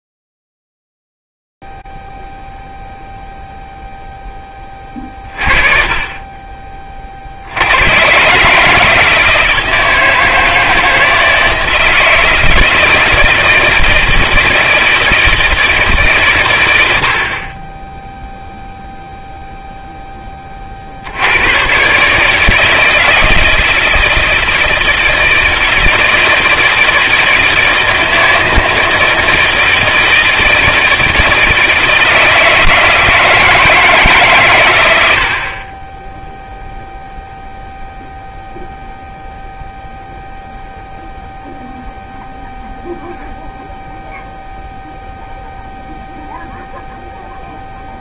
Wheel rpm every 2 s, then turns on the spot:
0, 0, 0, 30, 120, 160, 160, 160, 140, 10, 20, 160, 160, 160, 160, 160, 160, 130, 0, 0, 0, 0, 0, 0.
none